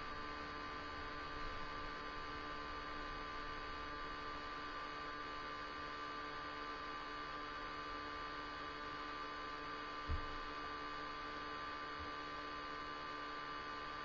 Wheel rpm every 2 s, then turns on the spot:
0, 0, 0, 0, 0, 0, 0.
none